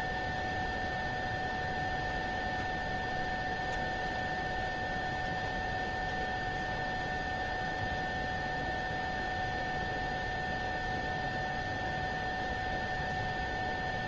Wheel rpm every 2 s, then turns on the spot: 0, 0, 0, 0, 0, 0, 0.
none